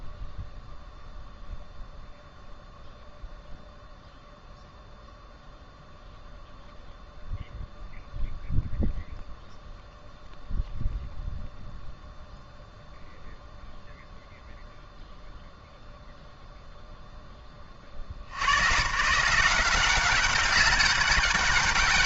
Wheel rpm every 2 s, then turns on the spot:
0, 0, 0, 0, 0, 0, 0, 0, 0, 120, 200.
none